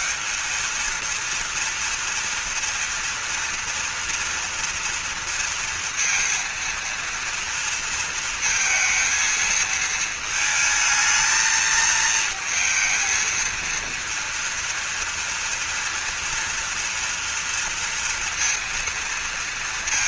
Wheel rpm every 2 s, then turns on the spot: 220, 230, 230, 230, 230, 220, 220, 230, 230, 230.
none